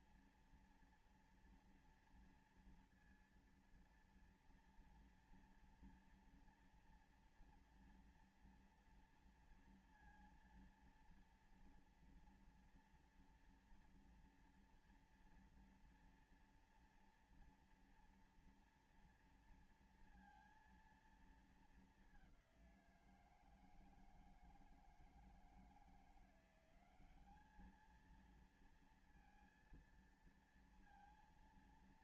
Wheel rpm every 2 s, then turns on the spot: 230, 230, 230, 230, 240, 230, 240, 240, 240, 230, 230, 190, 160, 180, 230, 230.
none